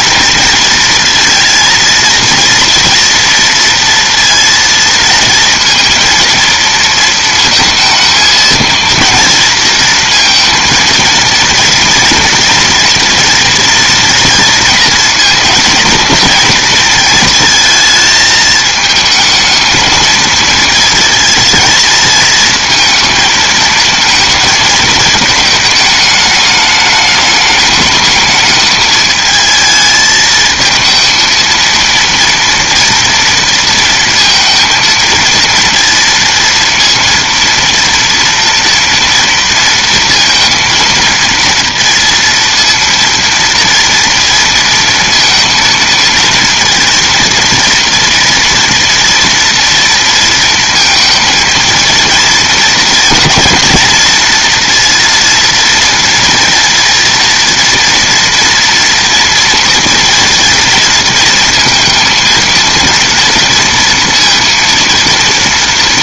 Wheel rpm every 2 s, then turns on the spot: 230, 230, 230, 230, 230, 230, 230, 230, 230, 220, 230, 220, 220, 210, 220, 220, 230, 230, 230, 230, 230, 230, 230, 230, 230, 230, 220, 230, 240, 230, 230, 230, 230.
none